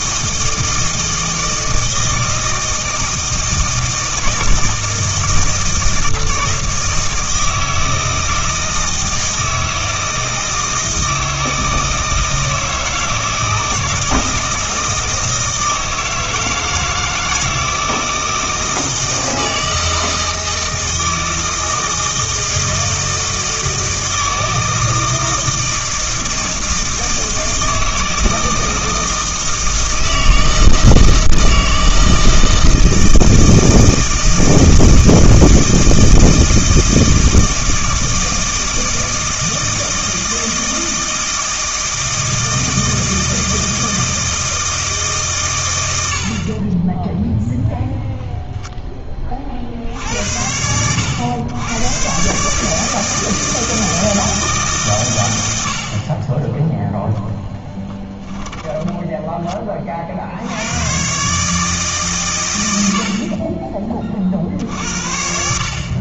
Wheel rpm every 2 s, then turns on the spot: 160, 160, 160, 160, 160, 160, 160, 160, 160, 160, 160, 160, 160, 160, 160, 160, 160, 160, 160, 160, 160, 160, 150, 30, 10, 90, 160, 140, 10, 10, 100, 80, 70.
46-48 58-60